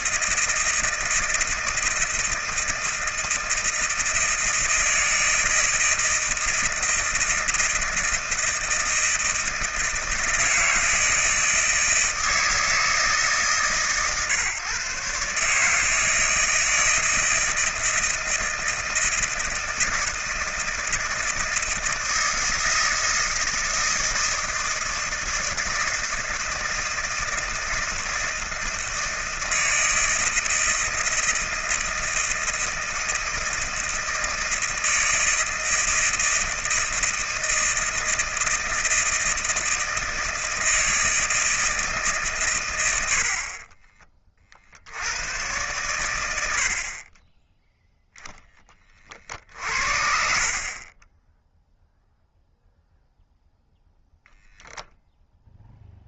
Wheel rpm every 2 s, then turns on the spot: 160, 160, 160, 160, 160, 170, 160, 140, 160, 160, 160, 160, 160, 160, 160, 160, 160, 160, 160, 160, 160, 120, 50, 70, 20, 30, 0, 0.
none